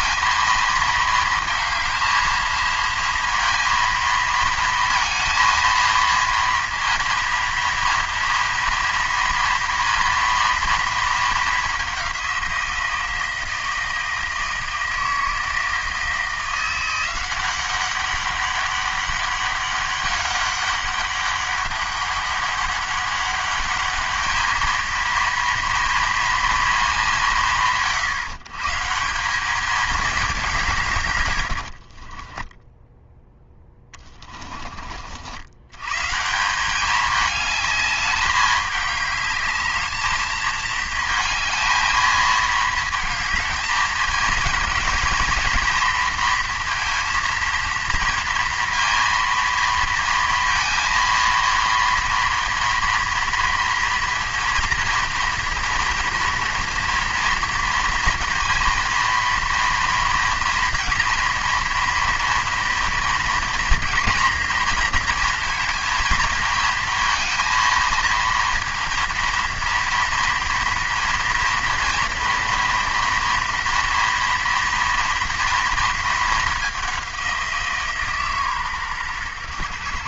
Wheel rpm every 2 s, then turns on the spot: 230, 220, 230, 230, 230, 230, 170, 160, 170, 200, 200, 200, 220, 220, 160, 160, 10, 40, 200, 210, 220, 230, 230, 230, 230, 230, 230, 230, 230, 230, 230, 230, 240, 220, 230, 230, 240, 230, 200, 130.
32-34